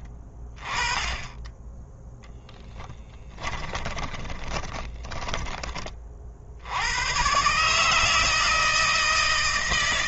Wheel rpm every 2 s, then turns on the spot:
20, 10, 20, 100, 160.
4-6